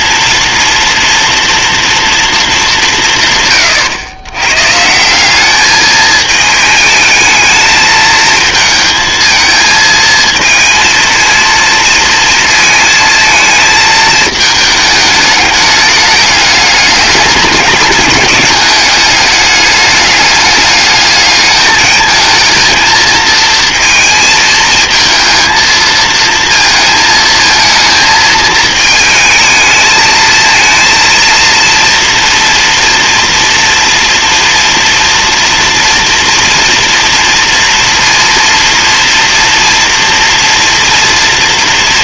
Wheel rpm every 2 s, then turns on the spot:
240, 160, 180, 220, 220, 230, 220, 210, 210, 210, 210, 230, 230, 230, 220, 230, 230, 230, 230, 240, 230.
none